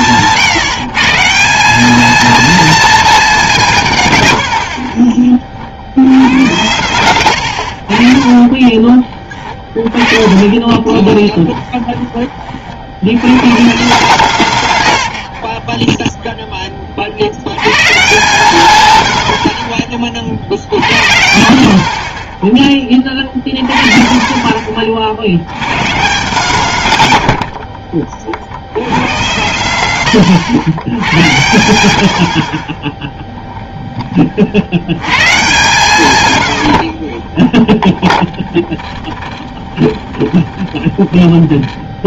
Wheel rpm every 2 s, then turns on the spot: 160, 230, 80, 110, 30, 20, 40, 110, 20, 130, 70, 20, 30, 160, 80, 100, 40, 50, 90, 20, 20.
8-12 38-42